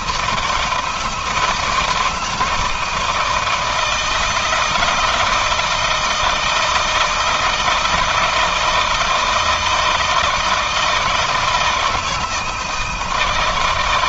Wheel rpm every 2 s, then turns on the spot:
160, 160, 160, 160, 170, 160, 160.
none